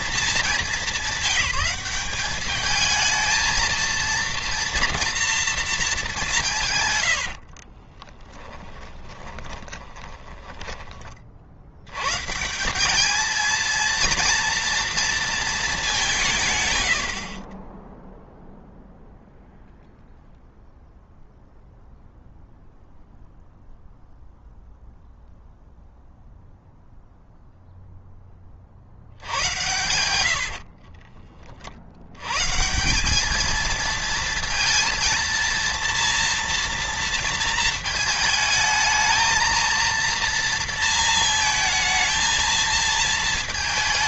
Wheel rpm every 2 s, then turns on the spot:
200, 220, 230, 110, 20, 20, 190, 230, 120, 0, 0, 0, 0, 0, 30, 70, 150, 230, 230, 220, 230, 220.
6-10 30-32